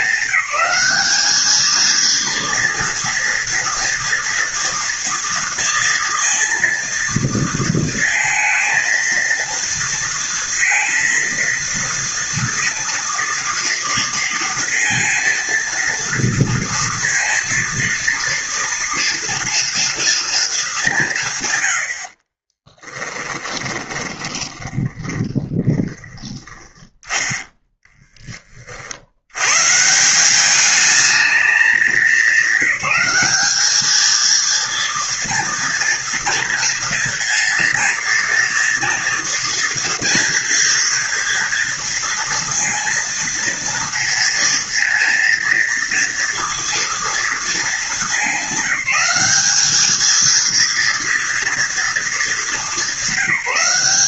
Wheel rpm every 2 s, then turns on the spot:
210, 230, 230, 230, 230, 230, 230, 230, 230, 230, 180, 10, 10, 10, 50, 210, 210, 230, 230, 230, 230, 230, 230, 230, 190, 230, 200.
22-24